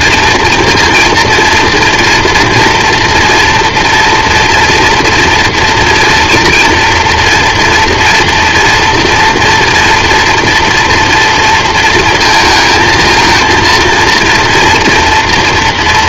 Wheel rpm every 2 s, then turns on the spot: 230, 230, 240, 230, 230, 230, 220, 230.
none